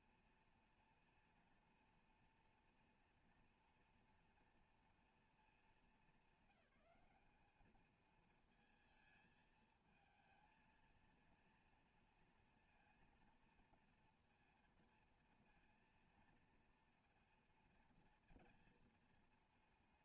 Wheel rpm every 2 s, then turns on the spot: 230, 230, 230, 210, 230, 230, 230, 230, 230, 230.
none